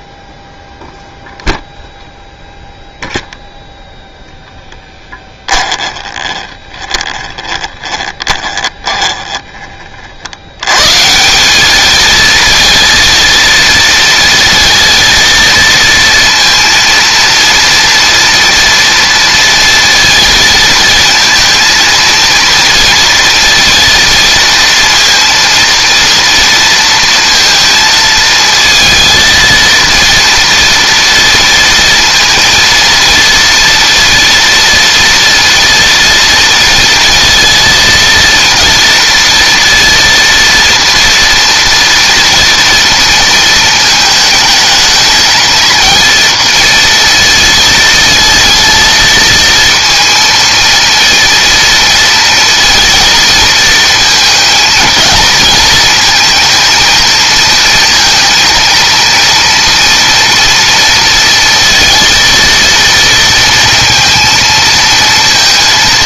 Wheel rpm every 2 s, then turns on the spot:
0, 0, 10, 20, 20, 130, 230, 230, 230, 230, 220, 230, 230, 230, 230, 230, 230, 230, 230, 230, 230, 230, 220, 230, 230, 230, 230, 220, 230, 230, 230, 230, 220.
4-10